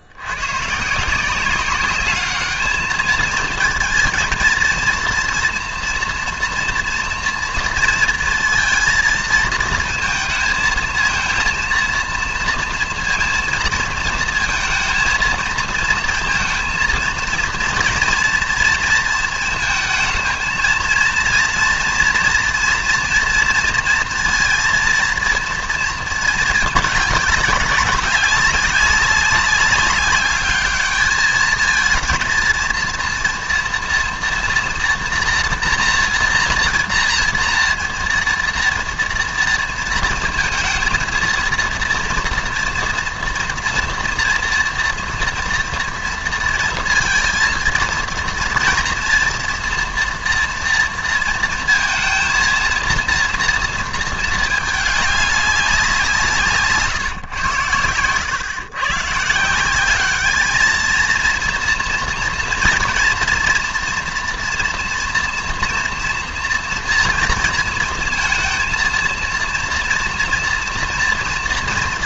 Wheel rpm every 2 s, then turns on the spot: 120, 210, 230, 230, 230, 220, 230, 230, 230, 230, 230, 240, 230, 220, 200, 210, 230, 230, 230, 230, 230, 230, 230, 230, 240, 240, 230, 210, 150, 120, 220, 230, 230, 230, 230, 230.
none